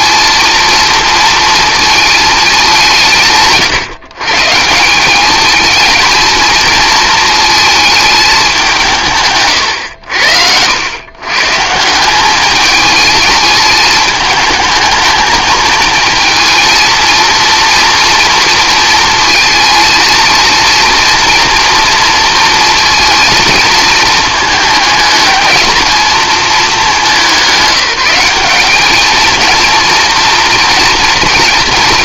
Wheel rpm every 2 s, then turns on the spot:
230, 190, 150, 230, 180, 90, 210, 220, 230, 230, 230, 230, 220, 220, 200, 240.
none